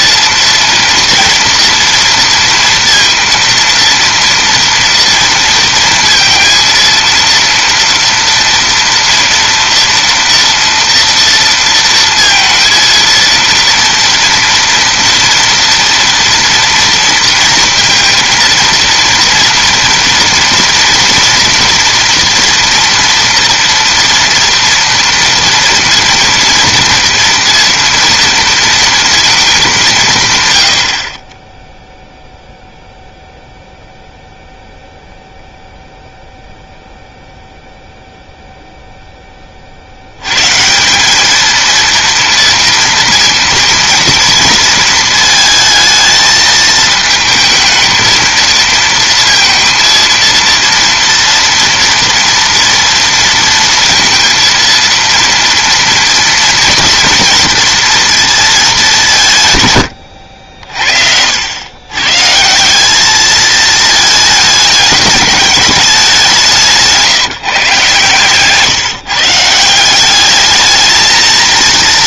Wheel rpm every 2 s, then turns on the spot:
230, 230, 240, 230, 230, 230, 230, 240, 230, 230, 230, 230, 230, 230, 230, 130, 0, 0, 0, 0, 140, 230, 220, 220, 230, 230, 230, 230, 230, 210, 60, 180, 210, 180, 150, 220.
none